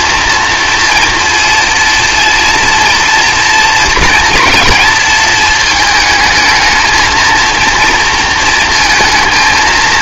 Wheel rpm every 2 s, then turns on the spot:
230, 240, 230, 220, 230.
none